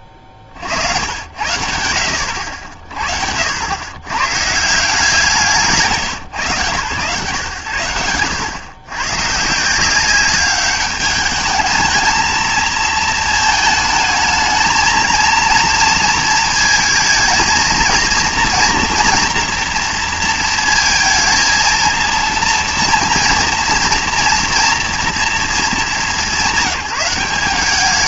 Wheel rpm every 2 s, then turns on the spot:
60, 50, 160, 140, 110, 200, 220, 220, 230, 240, 230, 230, 230, 170.
none